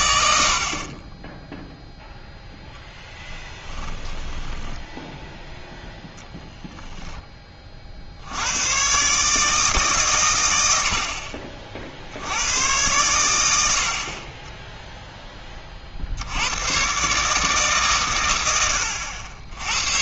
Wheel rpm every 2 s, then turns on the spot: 60, 0, 10, 0, 110, 80, 100, 0, 110, 90.
4-6